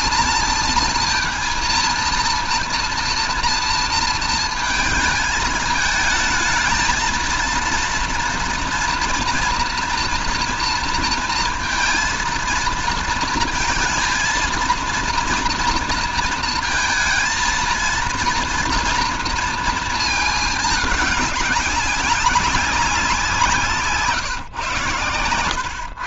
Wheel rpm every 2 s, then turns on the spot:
230, 230, 230, 220, 230, 230, 230, 230, 230, 230, 220, 190, 130.
none